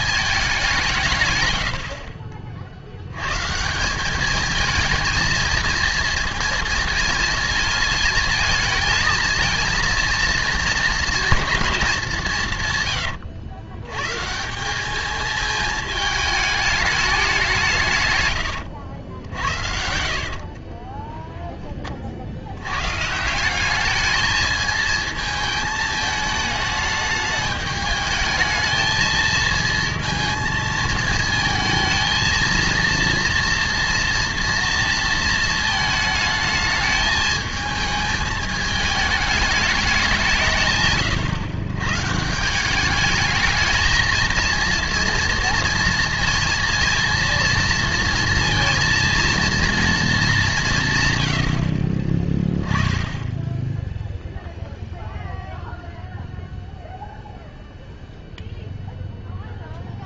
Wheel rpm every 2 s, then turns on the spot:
190, 50, 220, 230, 220, 220, 120, 180, 210, 100, 30, 100, 220, 210, 220, 220, 230, 230, 220, 220, 150, 190, 230, 230, 230, 170, 10, 0, 0, 0.
18-22 52-54